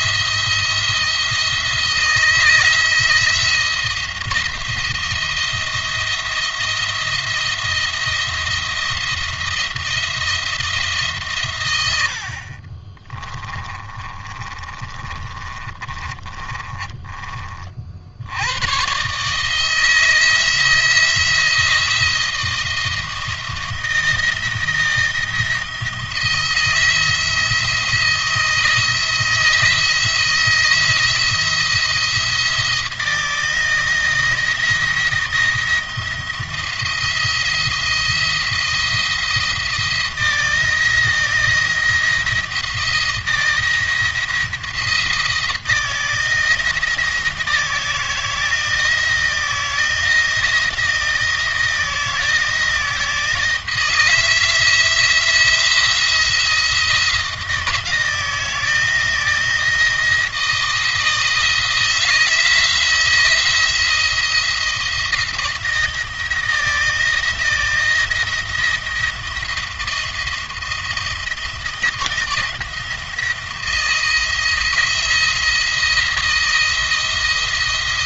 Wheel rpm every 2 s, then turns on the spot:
170, 160, 170, 170, 170, 160, 40, 30, 30, 120, 170, 170, 160, 170, 160, 160, 160, 170, 170, 170, 170, 170, 170, 170, 160, 170, 160, 160, 170, 170, 160, 170, 170, 170, 170, 170, 160, 170, 170.
12-18